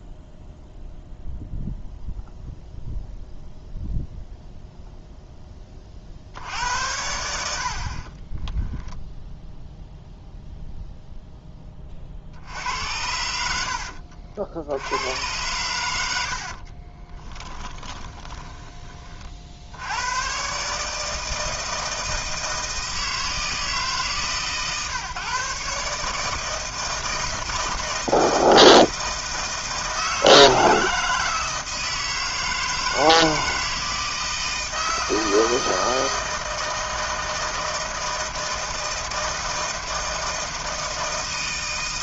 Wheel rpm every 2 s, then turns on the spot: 0, 0, 0, 70, 10, 0, 70, 80, 60, 20, 140, 160, 140, 160, 160, 160, 160, 160, 160, 160, 160.
8-10 16-18